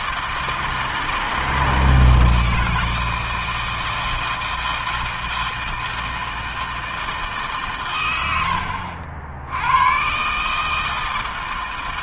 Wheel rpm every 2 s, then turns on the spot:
160, 160, 160, 160, 80, 140.
none